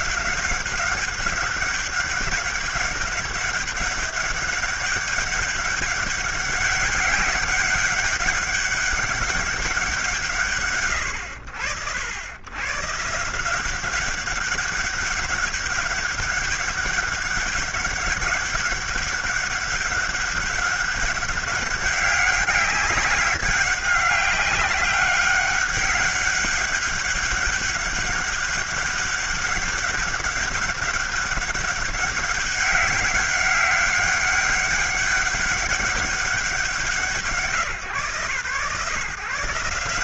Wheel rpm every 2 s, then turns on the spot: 190, 200, 200, 200, 190, 130, 100, 200, 190, 200, 200, 190, 200, 200, 200, 200, 190, 200, 180, 140.
none